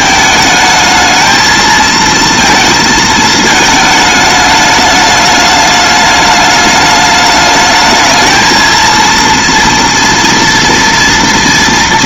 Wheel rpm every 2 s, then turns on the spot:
220, 230, 210, 210, 220, 230.
none